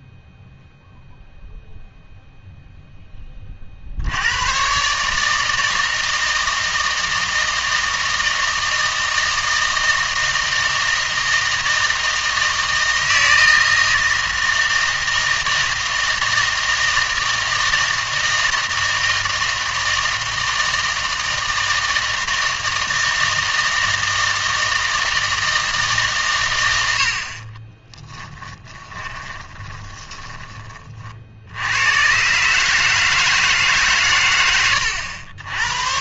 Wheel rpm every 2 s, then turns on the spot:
0, 0, 120, 160, 160, 160, 160, 160, 160, 160, 160, 160, 160, 120, 20, 20, 140, 100.
28-30